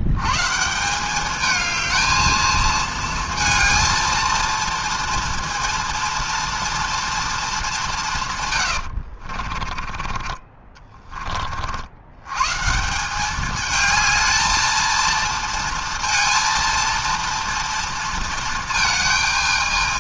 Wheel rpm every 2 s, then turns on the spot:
140, 220, 230, 230, 110, 20, 130, 220, 230, 220.
8-10